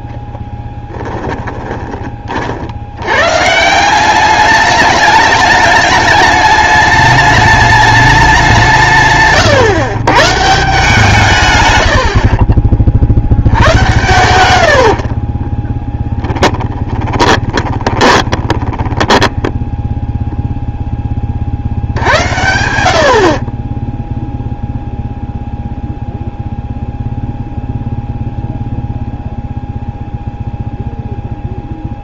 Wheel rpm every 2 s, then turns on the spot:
10, 80, 210, 210, 170, 160, 30, 70, 20, 10, 0, 70, 0, 0, 0, 0.
0-2 16-20